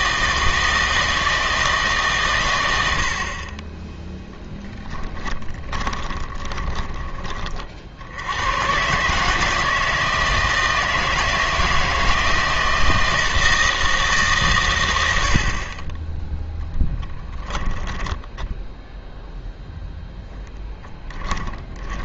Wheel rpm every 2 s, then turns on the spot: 160, 110, 10, 20, 120, 160, 160, 130, 10, 10, 10.
4-8 16-22